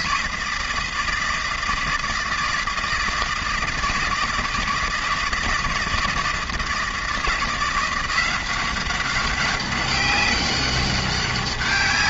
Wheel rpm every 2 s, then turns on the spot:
160, 160, 160, 160, 190, 200.
none